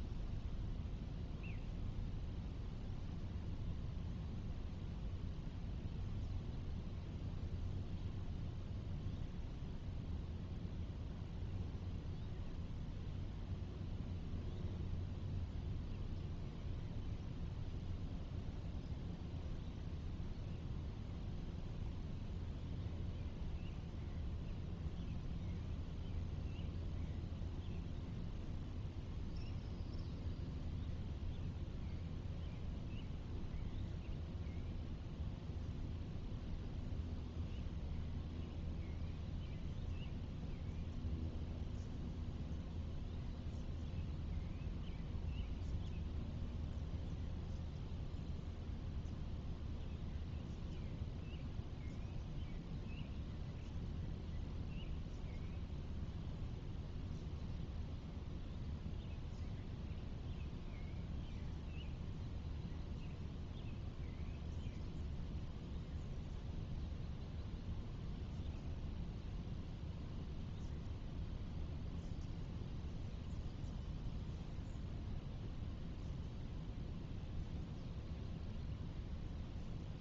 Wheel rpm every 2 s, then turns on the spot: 0, 0, 0, 0, 0, 0, 0, 0, 0, 0, 0, 0, 0, 0, 0, 0, 0, 0, 0, 0, 0, 0, 0, 0, 0, 0, 0, 0, 0, 0, 0, 0, 0, 0, 0, 0, 0, 0, 0, 0.
none